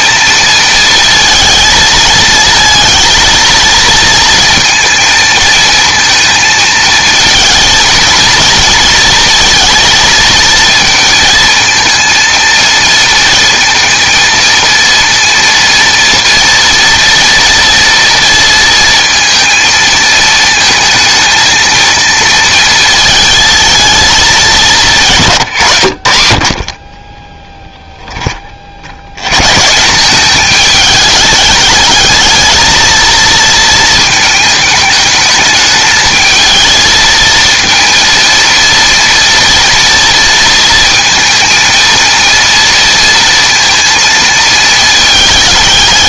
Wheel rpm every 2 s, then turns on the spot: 220, 230, 230, 230, 230, 230, 220, 230, 230, 230, 220, 220, 170, 40, 60, 210, 220, 220, 220, 230, 230, 230, 220.
none